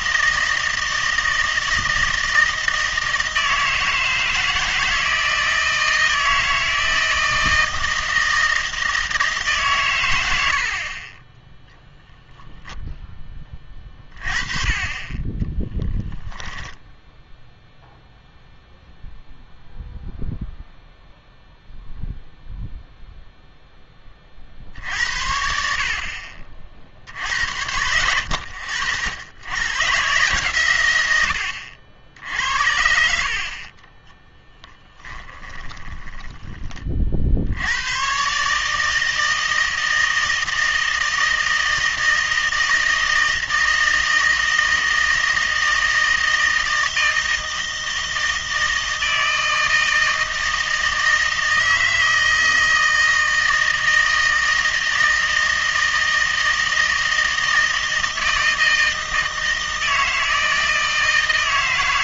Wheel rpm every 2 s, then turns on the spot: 160, 160, 160, 160, 160, 60, 0, 30, 0, 0, 0, 0, 60, 50, 50, 130, 70, 10, 30, 150, 160, 160, 160, 160, 160, 160, 160, 160, 160, 160, 160.
34-36